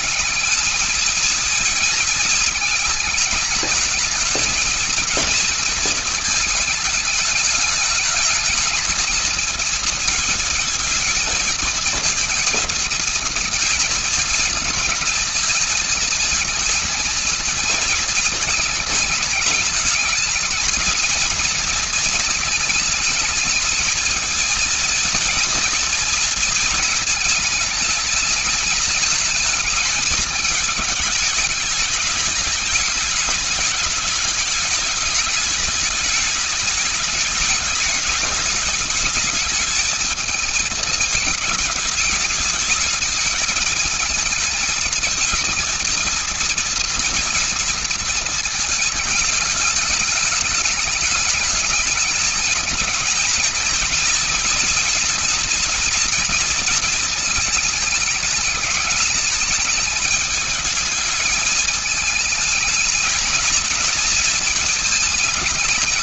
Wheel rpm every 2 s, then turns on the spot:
200, 220, 220, 220, 220, 220, 230, 220, 220, 220, 220, 220, 230, 220, 210, 220, 210, 210, 210, 210, 220, 210, 220, 230, 230, 210, 220, 230, 240, 210, 210, 220, 220.
none